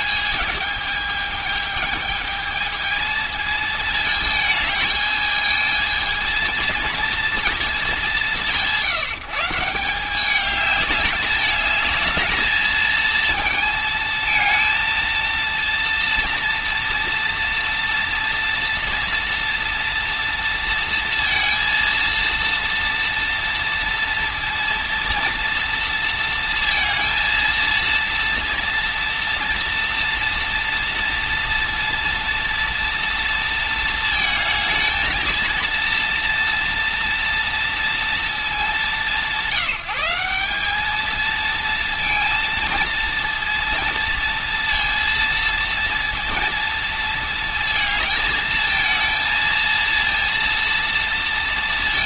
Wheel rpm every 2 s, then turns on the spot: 220, 220, 220, 230, 160, 200, 220, 230, 230, 230, 230, 230, 230, 230, 230, 230, 230, 220, 230, 200, 210, 230, 230, 230, 220, 230.
none